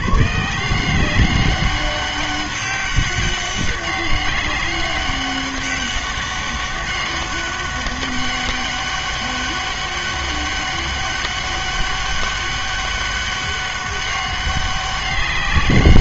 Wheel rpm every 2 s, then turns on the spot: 160, 200, 200, 200, 200, 200, 200, 200.
none